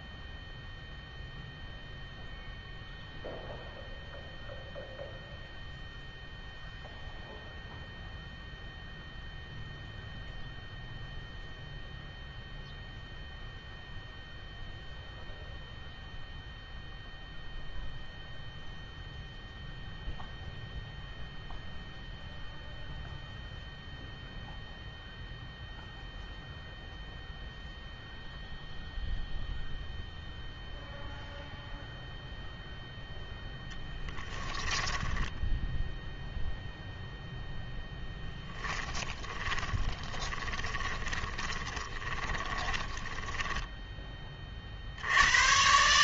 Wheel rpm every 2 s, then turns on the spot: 0, 0, 0, 0, 0, 0, 0, 0, 0, 0, 0, 0, 0, 0, 0, 0, 0, 10, 0, 10, 10, 20, 50.
34-36 38-44